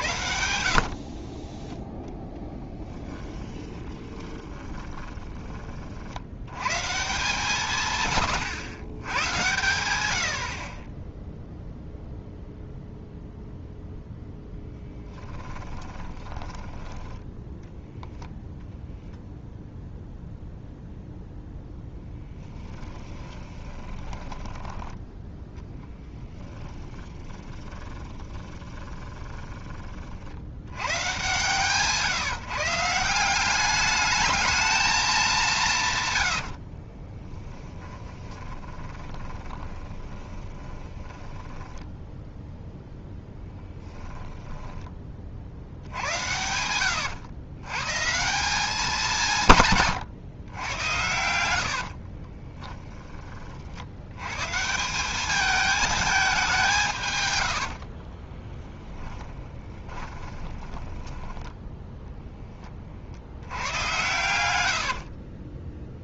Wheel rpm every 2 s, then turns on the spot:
70, 10, 20, 130, 100, 30, 0, 10, 20, 0, 0, 10, 10, 10, 20, 110, 150, 220, 50, 20, 20, 0, 10, 100, 200, 100, 20, 160, 170, 10, 20, 40, 80.
2-6 14-18 22-30 36-42 52-54 58-62 64-66